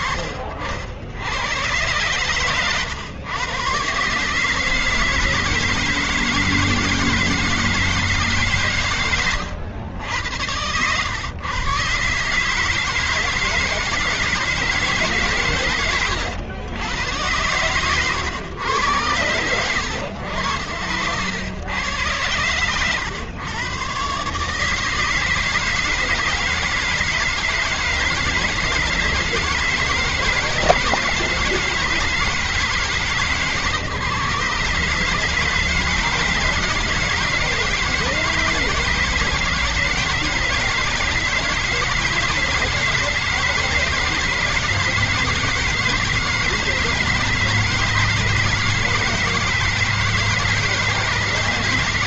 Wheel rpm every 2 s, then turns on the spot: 50, 110, 130, 160, 150, 90, 140, 160, 110, 120, 70, 100, 120, 160, 160, 160, 160, 140, 150, 160, 160, 160, 160, 160, 160, 160.
16-18